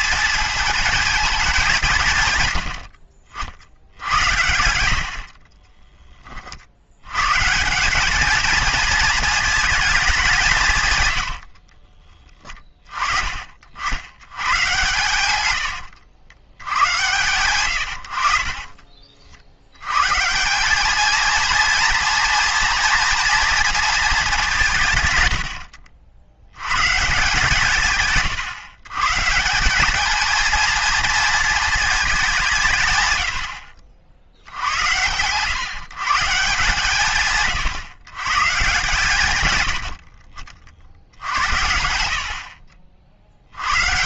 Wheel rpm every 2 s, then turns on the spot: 220, 100, 90, 50, 220, 160, 30, 120, 110, 40, 190, 240, 170, 90, 130, 230, 190, 70, 150, 140, 50, 50.
4-6 42-44